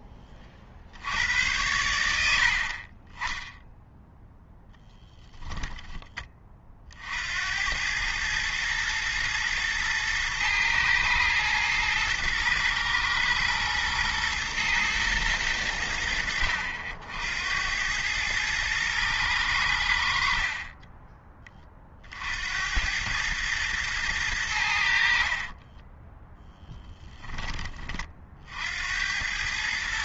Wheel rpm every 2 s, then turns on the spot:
60, 40, 10, 40, 110, 110, 110, 110, 70, 110, 30, 90, 70, 10, 60.
2-4